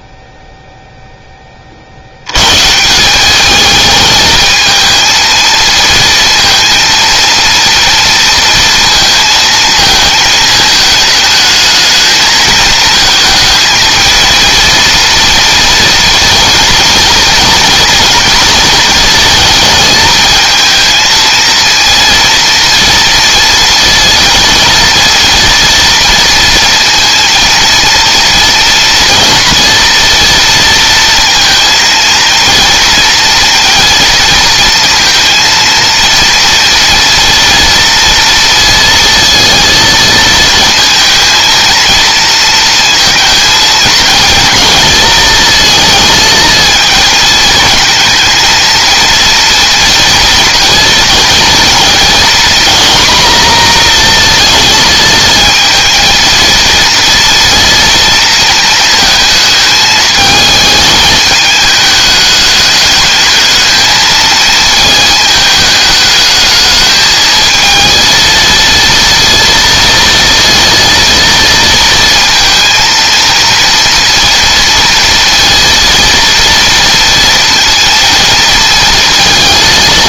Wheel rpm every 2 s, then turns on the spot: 0, 160, 220, 230, 230, 220, 220, 230, 230, 230, 220, 230, 230, 230, 230, 230, 230, 230, 240, 230, 230, 230, 230, 230, 230, 230, 240, 220, 230, 220, 220, 210, 220, 220, 230, 230, 230, 230, 230, 230.
none